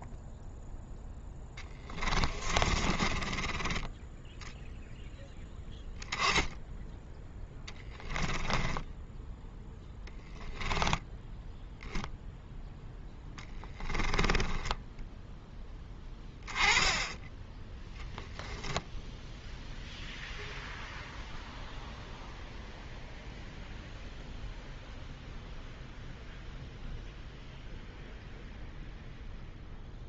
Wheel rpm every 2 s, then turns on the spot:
10, 30, 0, 10, 10, 10, 0, 10, 10, 0, 0, 0, 0, 0, 0.
2-4 8-10